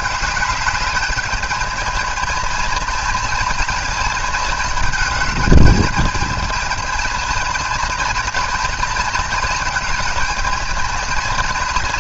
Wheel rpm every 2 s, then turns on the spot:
210, 230, 220, 220, 220, 220.
none